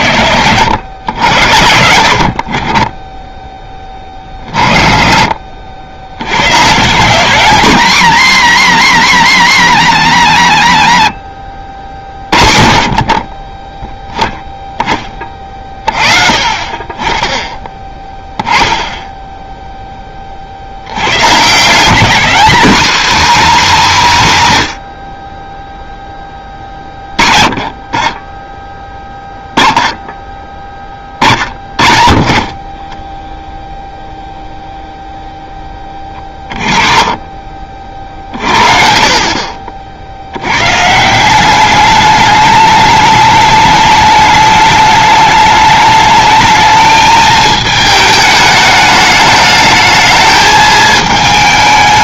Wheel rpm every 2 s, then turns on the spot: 70, 20, 30, 150, 130, 70, 30, 20, 30, 10, 120, 270, 60, 30, 10, 10, 10, 0, 30, 50, 160, 210, 210, 220, 210, 220.
10-12